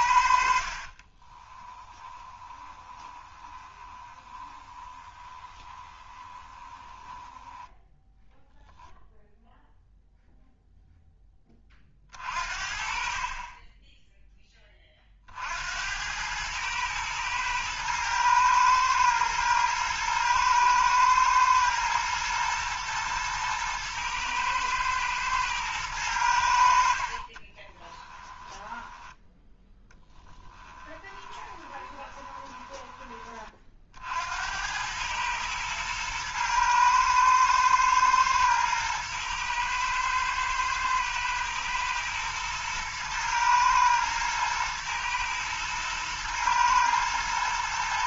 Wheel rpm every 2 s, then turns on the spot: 50, 20, 20, 20, 0, 0, 50, 20, 110, 110, 110, 110, 110, 70, 10, 20, 20, 90, 110, 110, 110, 110, 120, 110.
0-8 28-34